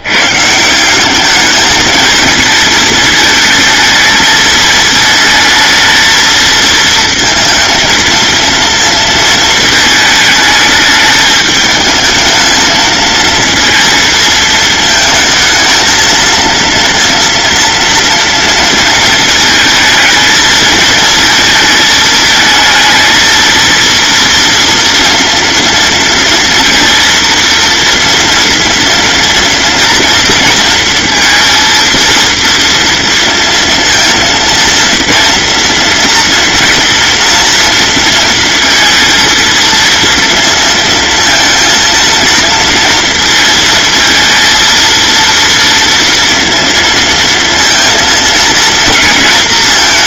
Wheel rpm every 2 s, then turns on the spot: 170, 220, 220, 230, 230, 210, 220, 220, 230, 230, 220, 220, 230, 230, 230, 230, 230, 230, 230, 230, 230, 230, 230, 230, 220.
none